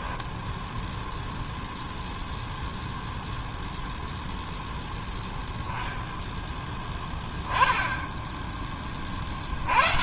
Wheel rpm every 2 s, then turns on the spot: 0, 0, 0, 10, 20.
none